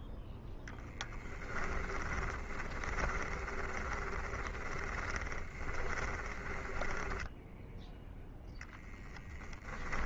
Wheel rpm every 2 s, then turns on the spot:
0, 10, 20, 10, 10.
2-10